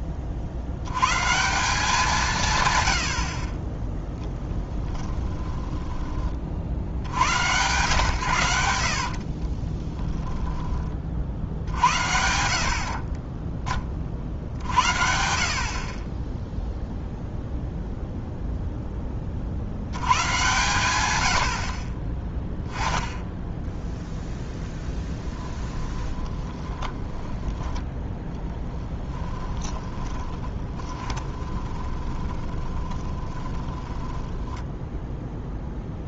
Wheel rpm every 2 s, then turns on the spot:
80, 110, 10, 60, 70, 20, 50, 60, 0, 10, 110, 10, 0, 10, 10, 20, 20, 10.
4-6 8-10 26-34